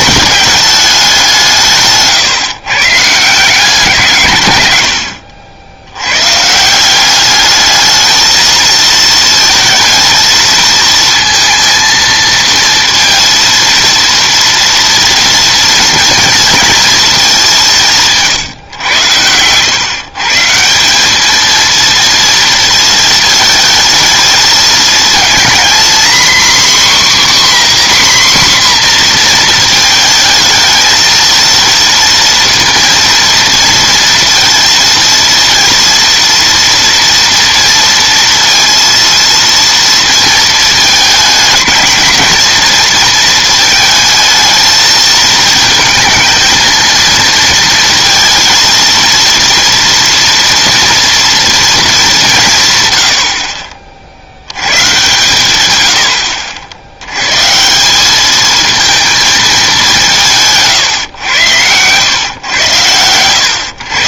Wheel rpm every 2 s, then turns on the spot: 210, 130, 110, 160, 220, 220, 230, 230, 230, 140, 170, 220, 220, 260, 250, 220, 230, 230, 230, 230, 230, 230, 220, 220, 230, 230, 150, 90, 70, 220, 150, 120.
none